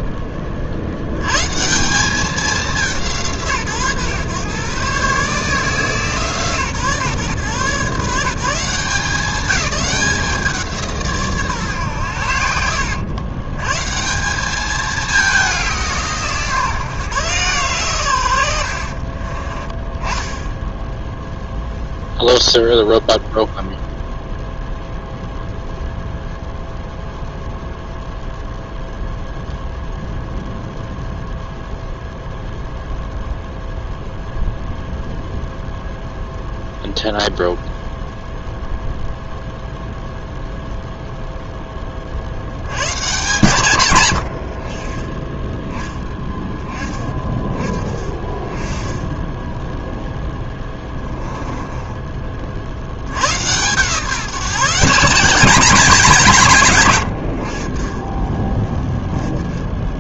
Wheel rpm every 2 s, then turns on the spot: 50, 190, 130, 150, 170, 170, 80, 210, 150, 70, 10, 0, 0, 0, 0, 0, 0, 0, 0, 0, 0, 90, 50, 20, 20, 10, 50, 170, 140, 30.
18-20 50-52